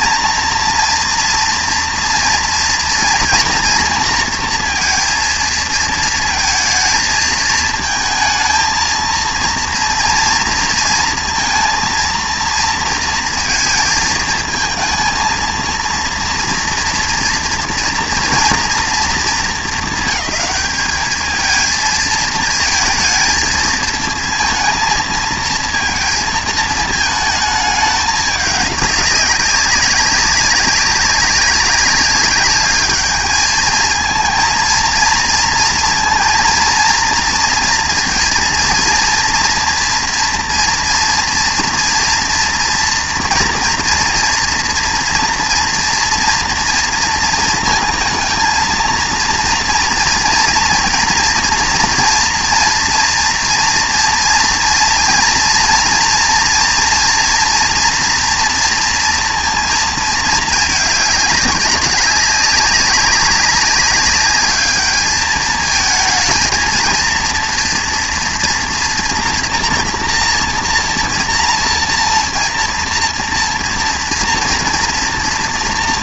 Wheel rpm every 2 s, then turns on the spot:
230, 230, 230, 220, 220, 230, 230, 220, 230, 230, 220, 220, 220, 220, 200, 190, 210, 230, 230, 230, 230, 230, 230, 230, 230, 230, 230, 230, 230, 230, 210, 200, 210, 230, 240, 240, 230, 230.
none